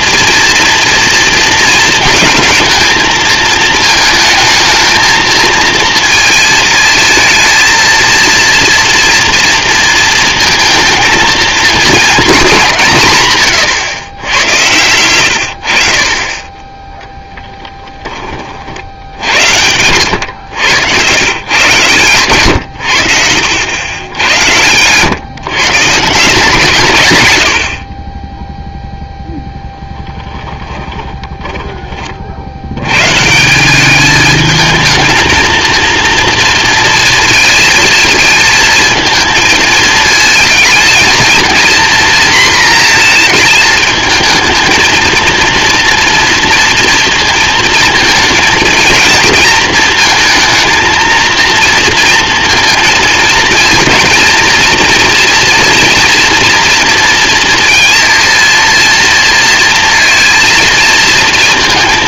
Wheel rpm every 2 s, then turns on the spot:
230, 220, 220, 220, 230, 230, 200, 100, 20, 50, 100, 100, 100, 160, 0, 20, 80, 220, 230, 220, 220, 240, 220, 230, 230, 230, 230, 230, 240, 230, 230.
14-16 30-32